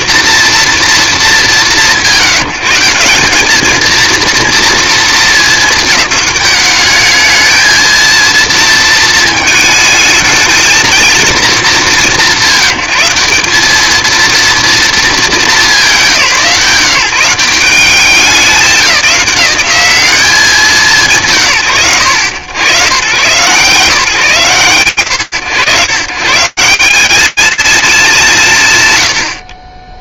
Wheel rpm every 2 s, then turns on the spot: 230, 160, 230, 210, 230, 220, 170, 220, 160, 200, 170, 100, 90, 180, 130.
none